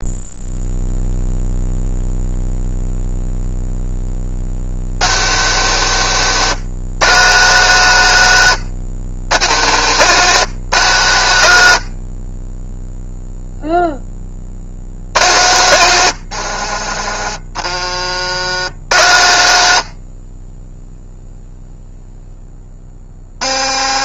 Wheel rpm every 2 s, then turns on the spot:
0, 0, 130, 150, 120, 130, 0, 100, 50, 90, 0, 30.
none